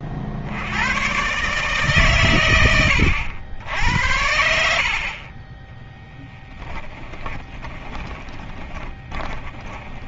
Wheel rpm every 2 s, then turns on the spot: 110, 90, 40, 10, 20.
6-10